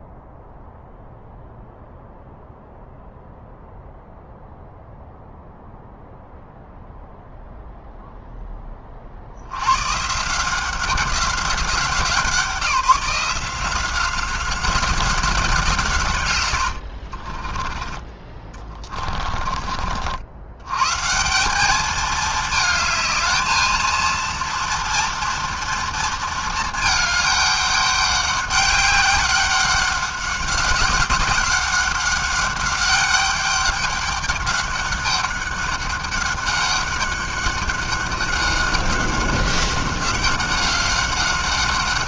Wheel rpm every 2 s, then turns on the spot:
0, 0, 0, 0, 10, 170, 170, 190, 100, 30, 90, 220, 230, 230, 200, 190, 200, 200, 200, 190, 190.
16-20